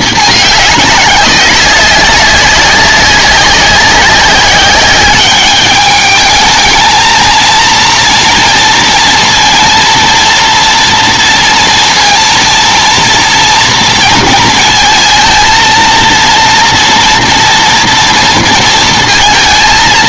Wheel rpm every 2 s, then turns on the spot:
220, 200, 200, 210, 230, 230, 230, 230, 230, 230.
none